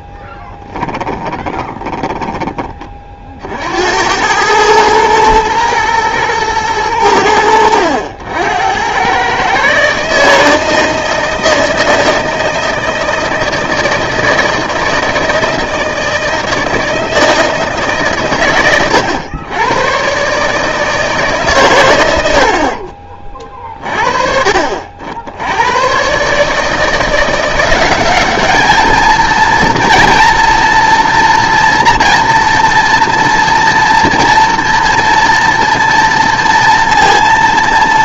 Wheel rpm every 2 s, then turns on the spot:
10, 20, 110, 110, 90, 160, 160, 160, 160, 110, 150, 60, 50, 150, 210, 230, 230, 230, 230.
0-2